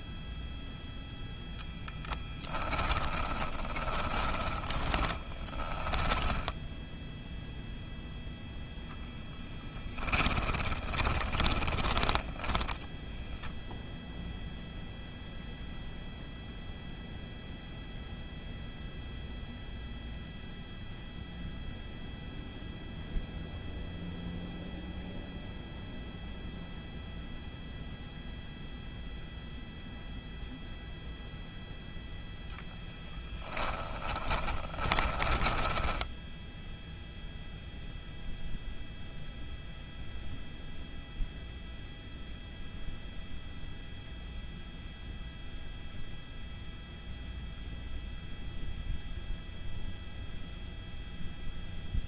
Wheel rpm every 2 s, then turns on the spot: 0, 20, 10, 0, 0, 10, 10, 0, 0, 0, 0, 0, 0, 0, 0, 0, 10, 20, 0, 0, 0, 0, 0, 0, 0, 0.
2-6 10-12 32-36